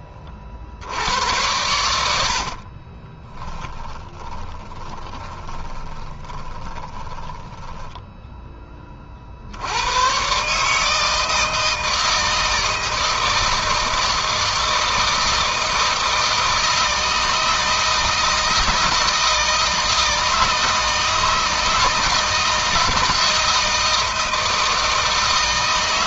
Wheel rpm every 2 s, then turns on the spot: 50, 50, 20, 20, 20, 140, 160, 160, 160, 160, 160, 160, 160.
2-8